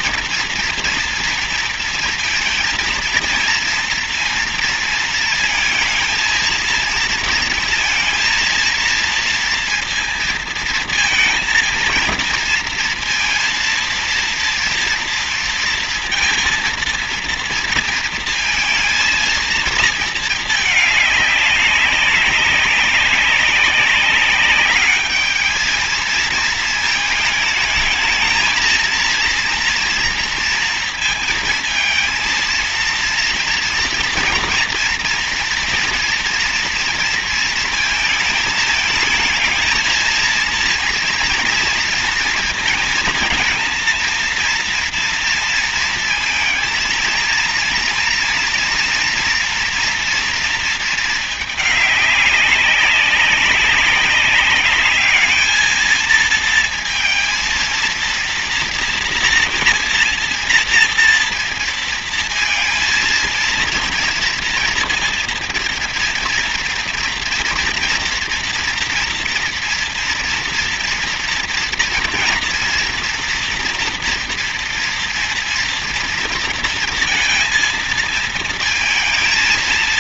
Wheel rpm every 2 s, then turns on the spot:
230, 230, 230, 230, 230, 230, 230, 230, 230, 230, 210, 190, 200, 220, 220, 230, 230, 230, 230, 220, 230, 230, 230, 230, 230, 230, 200, 200, 230, 230, 230, 230, 230, 230, 230, 230, 240, 230, 230, 230.
none